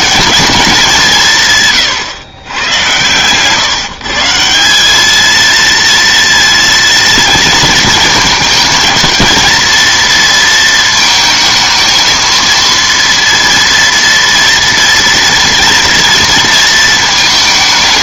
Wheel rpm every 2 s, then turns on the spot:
180, 110, 210, 230, 230, 220, 230, 230, 220.
2-4